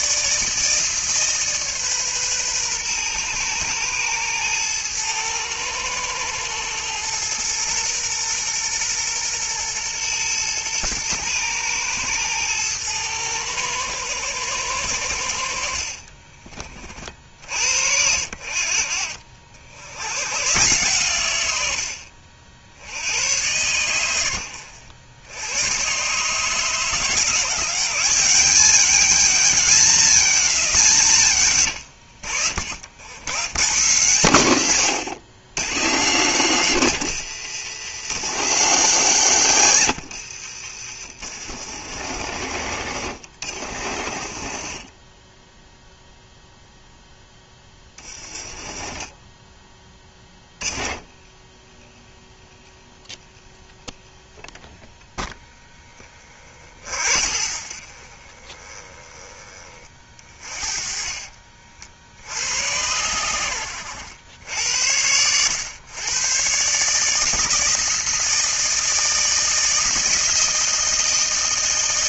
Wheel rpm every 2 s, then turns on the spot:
150, 130, 110, 110, 120, 110, 110, 100, 40, 70, 120, 70, 80, 150, 190, 190, 70, 130, 170, 180, 70, 70, 50, 0, 30, 20, 0, 0, 30, 20, 40, 90, 80, 130, 160, 160.
40-46 48-50 60-62